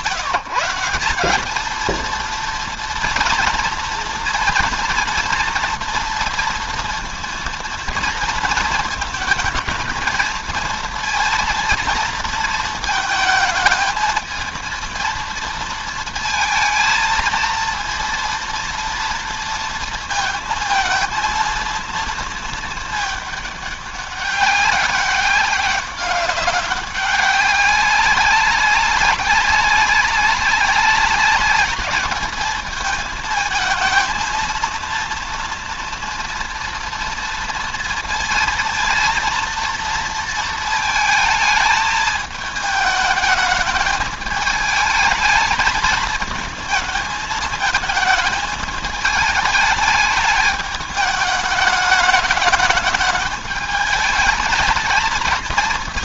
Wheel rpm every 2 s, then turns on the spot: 180, 230, 230, 230, 230, 220, 220, 220, 230, 230, 220, 220, 200, 200, 190, 200, 210, 230, 230, 230, 220, 210, 210, 220, 220, 210, 210, 220.
none